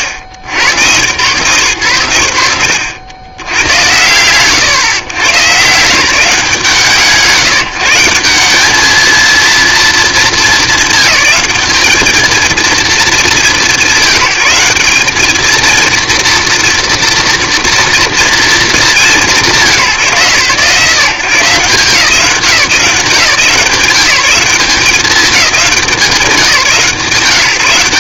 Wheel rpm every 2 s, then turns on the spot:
110, 90, 100, 150, 200, 210, 220, 190, 230, 230, 130, 170, 190, 160.
none